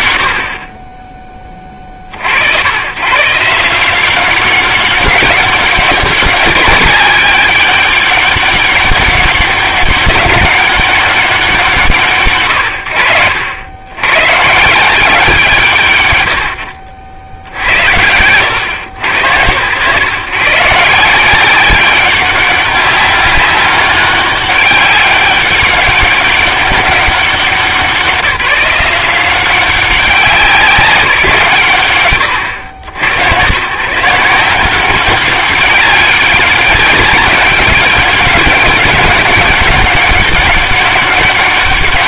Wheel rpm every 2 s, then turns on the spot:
90, 70, 190, 200, 200, 200, 100, 160, 90, 110, 150, 200, 200, 190, 170, 180, 110, 180, 200, 200, 200.
none